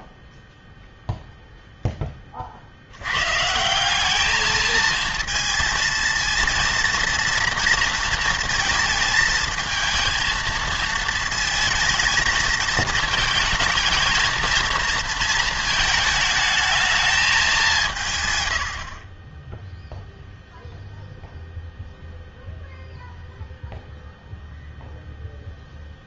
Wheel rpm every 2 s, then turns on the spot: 0, 50, 220, 230, 220, 230, 220, 230, 220, 100, 0, 0, 0.
none